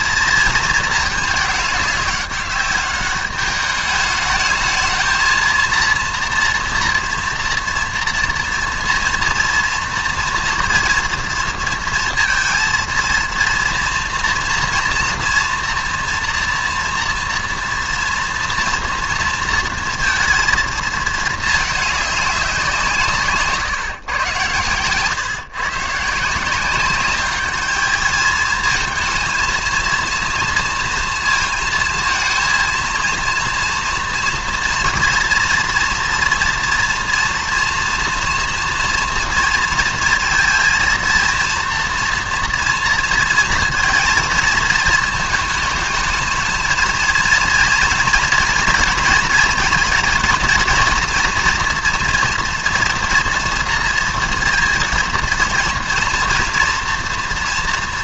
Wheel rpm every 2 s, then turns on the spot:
220, 200, 220, 230, 230, 230, 230, 230, 230, 230, 230, 180, 120, 180, 220, 230, 230, 230, 240, 240, 230, 230, 220, 220, 240, 230, 240, 230, 230.
24-26